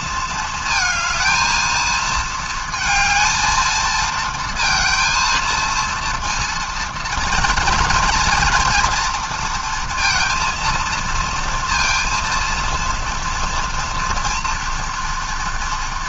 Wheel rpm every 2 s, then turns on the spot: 230, 220, 230, 230, 230, 230, 230, 230.
none